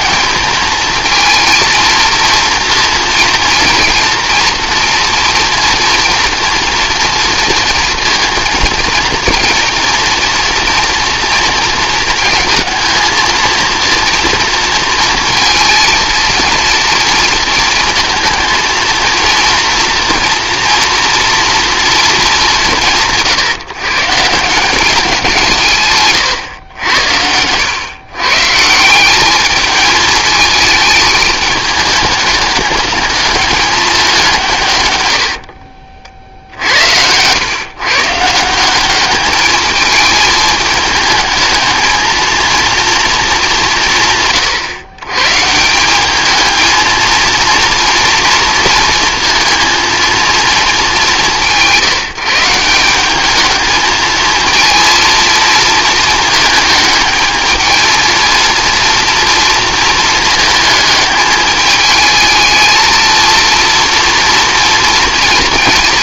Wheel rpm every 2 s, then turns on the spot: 230, 230, 230, 230, 230, 240, 230, 230, 230, 220, 230, 190, 180, 110, 170, 210, 210, 140, 70, 180, 210, 230, 130, 220, 230, 220, 180, 230, 220, 230, 220, 220, 230.
26-28